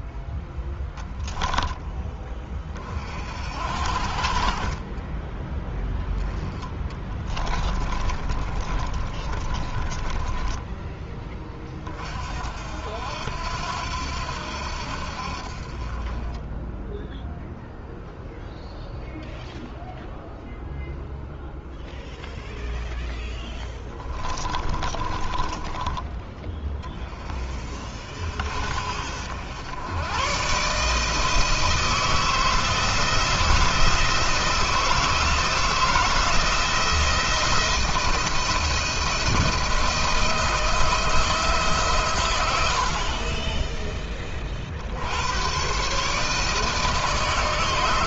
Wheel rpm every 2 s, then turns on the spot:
10, 30, 30, 10, 30, 10, 60, 80, 10, 0, 0, 0, 20, 20, 60, 140, 160, 160, 170, 170, 160, 70, 50, 150.
6-10 24-26